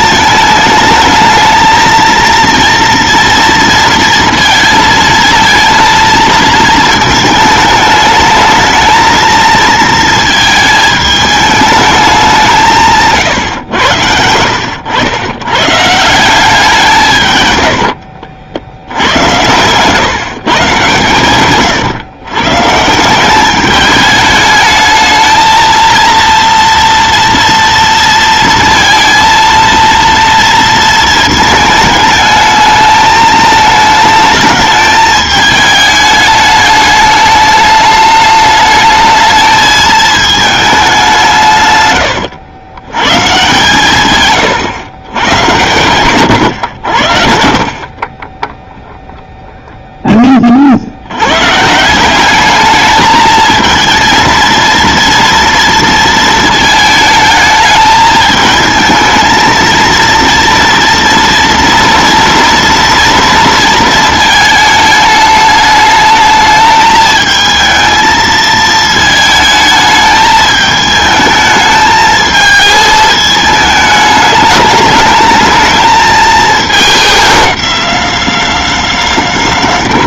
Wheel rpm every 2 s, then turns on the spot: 220, 230, 230, 220, 210, 220, 180, 90, 180, 80, 130, 130, 210, 230, 230, 230, 220, 220, 210, 210, 210, 90, 120, 100, 0, 40, 210, 230, 220, 220, 230, 230, 220, 220, 220, 220, 220, 210, 220, 210.
none